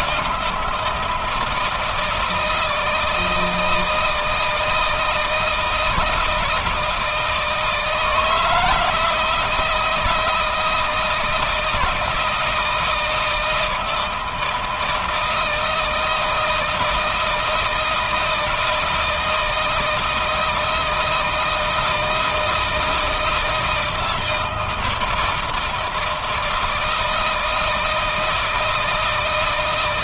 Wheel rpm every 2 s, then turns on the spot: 170, 160, 160, 160, 160, 170, 160, 160, 160, 160, 160, 160, 160, 160, 160.
none